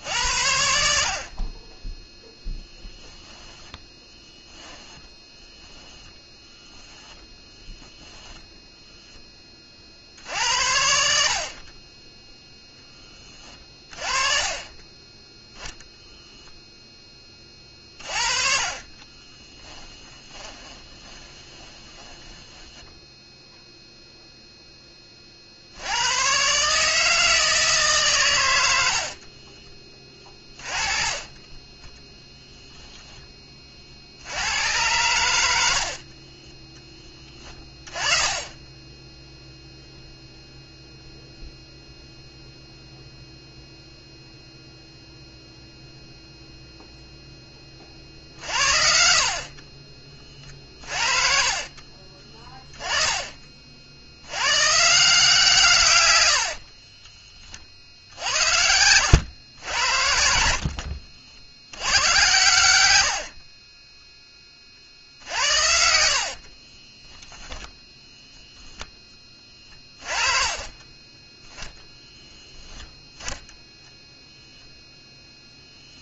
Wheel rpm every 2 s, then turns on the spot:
70, 10, 10, 0, 0, 70, 10, 20, 10, 30, 20, 10, 20, 150, 70, 20, 0, 110, 10, 20, 0, 0, 0, 0, 60, 40, 20, 150, 30, 90, 70, 100, 50, 20, 10, 30, 10, 0.
2-4 18-24 36-40 50-54 56-58 60-62 66-68 70-72